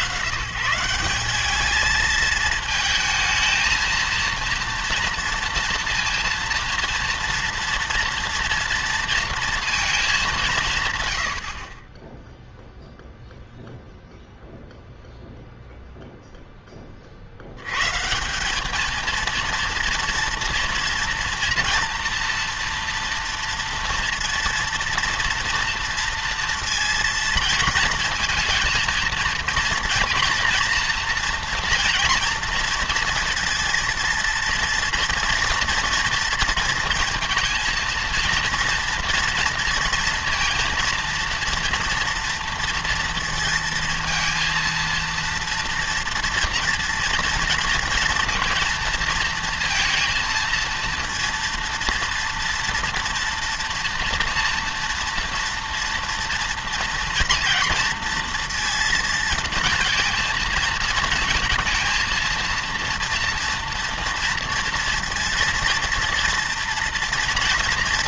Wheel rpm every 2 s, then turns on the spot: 130, 220, 230, 230, 230, 150, 0, 0, 20, 210, 230, 230, 230, 230, 230, 240, 230, 230, 230, 230, 230, 230, 230, 230, 230, 230, 230, 230, 230, 230, 220, 230, 230, 230.
none